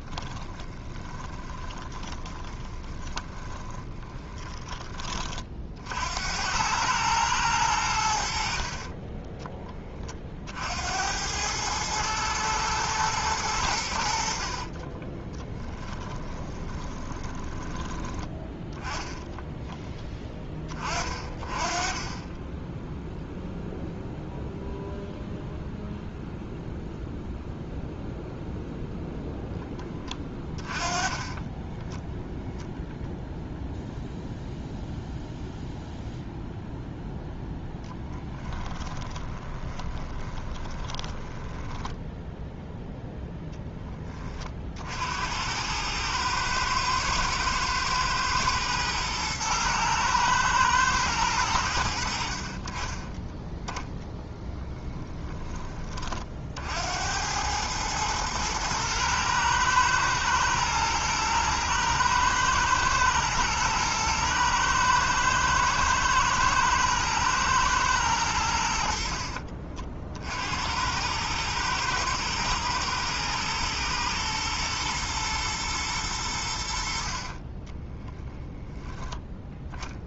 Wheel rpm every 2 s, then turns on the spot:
20, 20, 30, 110, 40, 70, 110, 40, 20, 10, 30, 10, 0, 0, 0, 20, 0, 0, 0, 20, 20, 0, 60, 110, 110, 110, 30, 10, 70, 110, 110, 120, 110, 110, 60, 90, 110, 110, 70, 10.
0-4 8-10 14-18 30-32 38-42